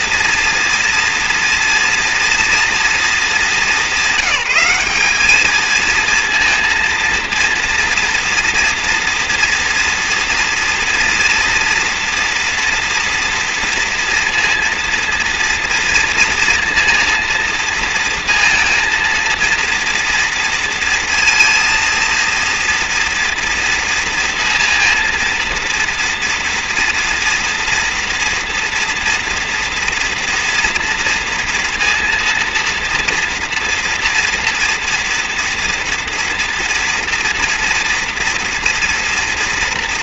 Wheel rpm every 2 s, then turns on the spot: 230, 240, 190, 230, 230, 230, 230, 230, 230, 230, 230, 230, 230, 230, 230, 230, 230, 230, 230, 230.
none